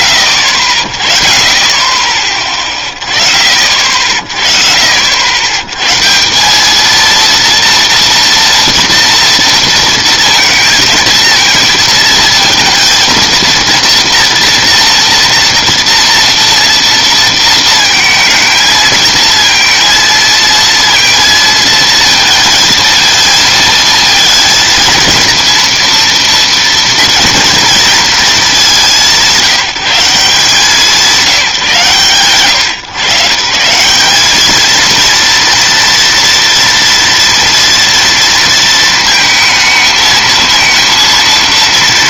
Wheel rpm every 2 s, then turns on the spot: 20, 40, 90, 230, 230, 220, 230, 230, 230, 230, 230, 230, 230, 230, 170, 180, 160, 240, 230, 220, 230.
none